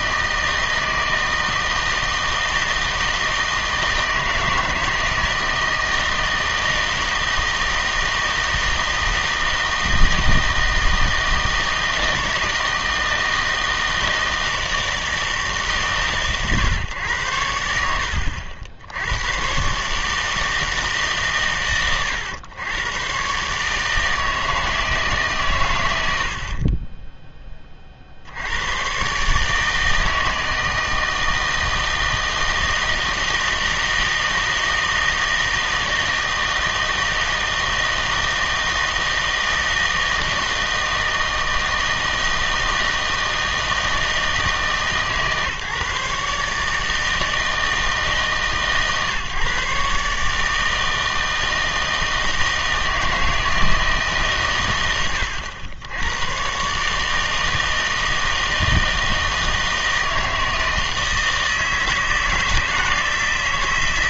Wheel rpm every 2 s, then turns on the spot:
160, 160, 160, 160, 160, 160, 160, 160, 120, 70, 150, 100, 160, 30, 110, 160, 160, 160, 160, 160, 160, 160, 150, 150, 140, 160, 160, 110, 140, 160, 160, 160.
26-28